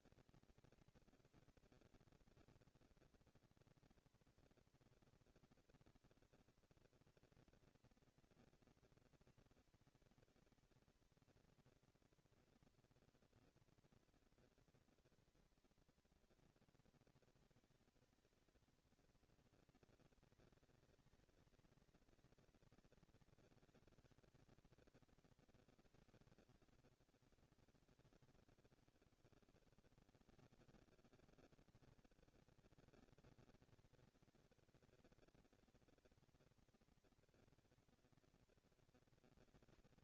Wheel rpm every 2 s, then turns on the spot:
220, 230, 240, 240, 230, 220, 230, 230, 230, 220, 220, 230, 220, 120, 130, 110, 210, 220, 240, 230.
none